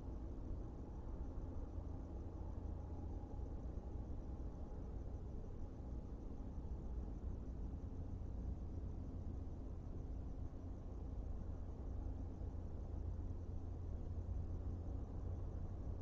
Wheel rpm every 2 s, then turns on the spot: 0, 0, 0, 0, 0, 0, 0, 0.
none